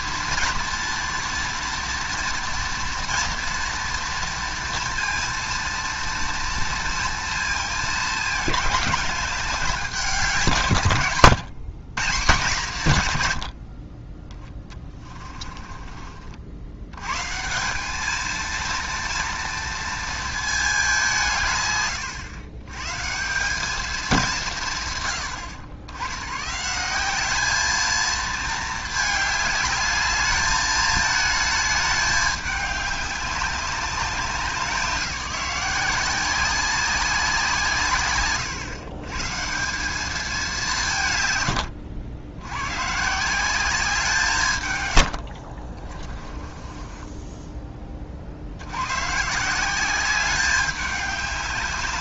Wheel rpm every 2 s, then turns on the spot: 240, 230, 230, 230, 200, 150, 140, 20, 90, 230, 210, 110, 140, 160, 220, 210, 210, 190, 190, 130, 180, 110, 130, 20, 90, 200.
14-16 46-48